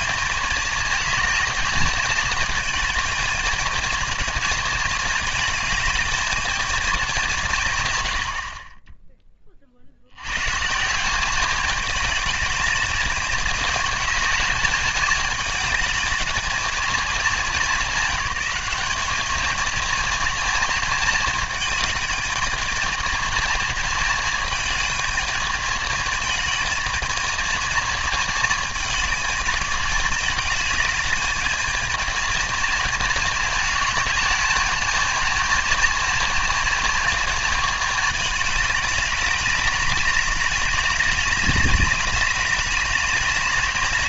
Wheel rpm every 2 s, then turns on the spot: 220, 220, 220, 210, 30, 150, 210, 210, 210, 200, 220, 220, 220, 220, 220, 210, 220, 220, 230, 210, 200, 200.
none